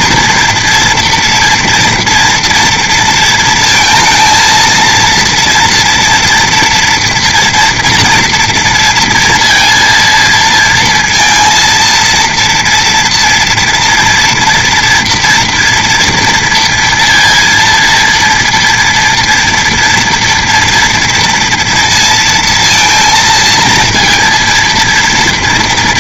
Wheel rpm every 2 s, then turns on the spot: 230, 230, 220, 230, 230, 230, 230, 230, 230, 230, 230, 230, 230.
none